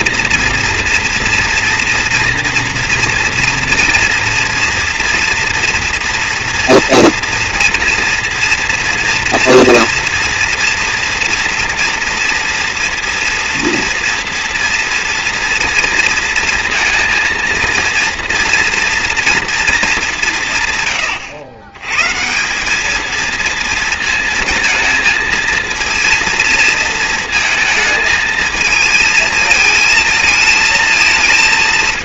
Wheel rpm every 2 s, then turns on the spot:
230, 240, 230, 240, 230, 230, 230, 230, 230, 230, 120, 210, 230, 230, 220, 220.
none